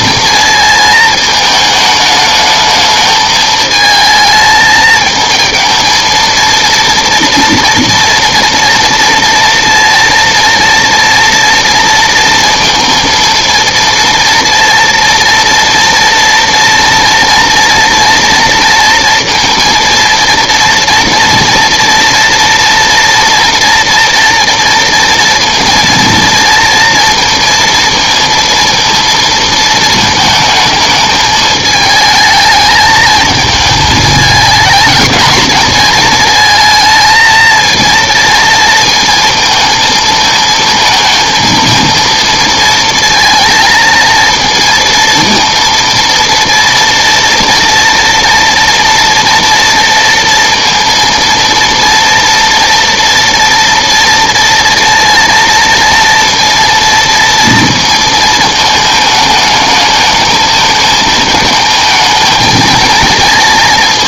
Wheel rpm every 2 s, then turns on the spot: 220, 220, 220, 230, 230, 230, 230, 230, 230, 230, 230, 230, 230, 230, 230, 220, 210, 220, 220, 230, 220, 230, 230, 230, 230, 230, 230, 230, 230, 220, 220, 220.
none